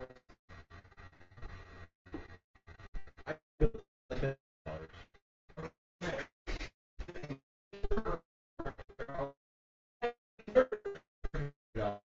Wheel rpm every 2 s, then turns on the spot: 0, 0, 0, 0, 0, 0.
none